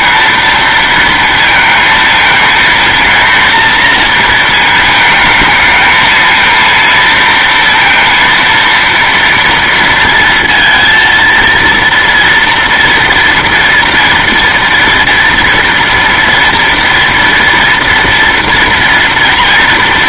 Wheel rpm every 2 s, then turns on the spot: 230, 230, 220, 230, 230, 230, 230, 230, 230, 230.
none